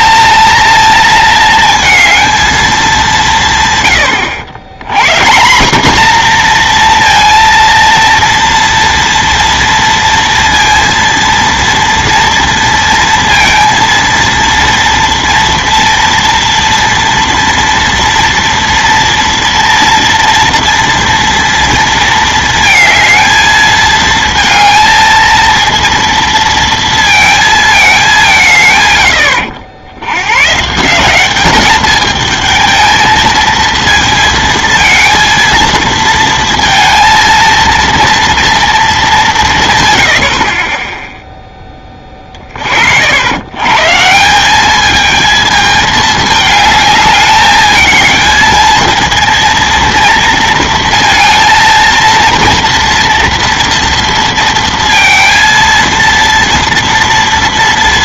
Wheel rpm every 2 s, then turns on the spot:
230, 220, 110, 240, 230, 230, 230, 230, 230, 230, 230, 220, 230, 230, 140, 130, 220, 230, 230, 230, 30, 40, 210, 210, 220, 230, 230, 230, 230.
none